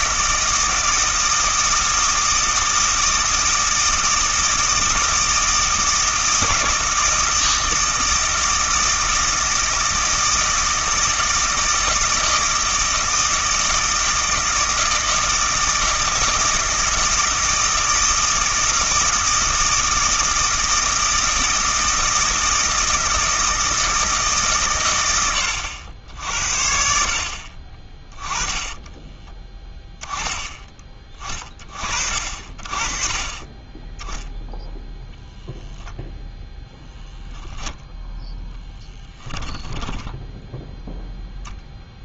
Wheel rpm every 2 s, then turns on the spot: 160, 160, 160, 160, 160, 160, 160, 160, 160, 160, 160, 160, 130, 60, 20, 10, 40, 0, 0, 10, 0.
none